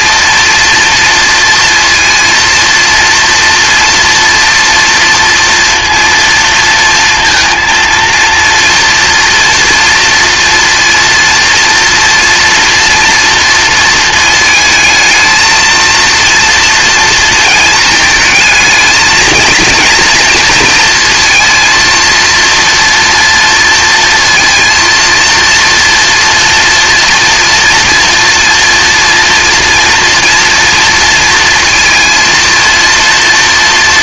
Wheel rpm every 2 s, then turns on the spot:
230, 230, 230, 230, 230, 230, 230, 230, 230, 220, 230, 240, 230, 230, 230, 230, 230.
none